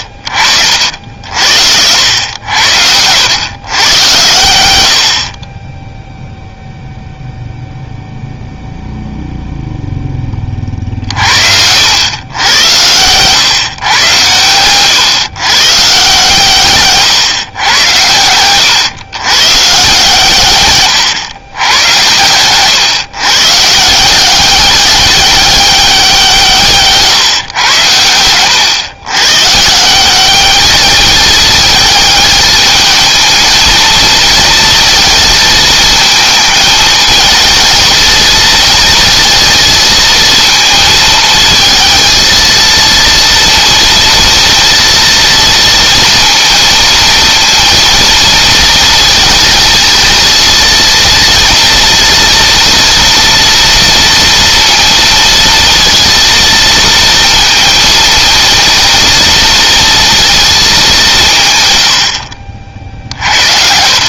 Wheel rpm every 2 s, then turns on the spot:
60, 90, 80, 0, 0, 50, 110, 120, 140, 120, 120, 130, 200, 150, 120, 210, 220, 230, 220, 230, 230, 230, 230, 230, 230, 230, 230, 230, 230, 230, 200, 50.
20-22